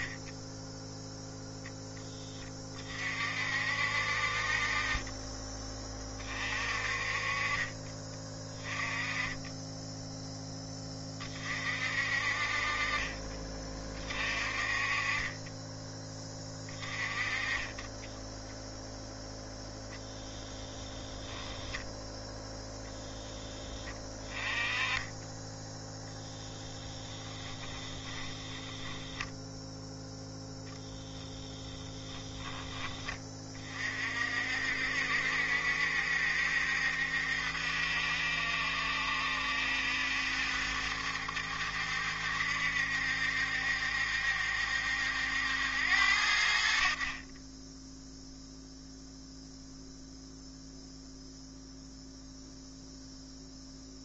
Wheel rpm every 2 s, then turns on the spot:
0, 30, 40, 30, 20, 20, 30, 30, 20, 0, 10, 10, 20, 10, 10, 20, 20, 60, 70, 70, 70, 70, 70, 50, 0, 0, 0.
12-14 20-22 28-32